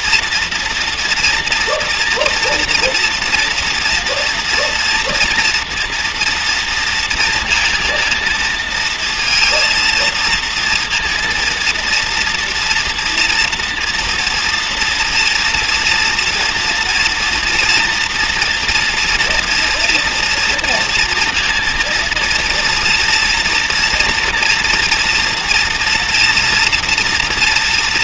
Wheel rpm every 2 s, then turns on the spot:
230, 230, 240, 230, 230, 230, 230, 230, 230, 230, 230, 230, 230, 230.
none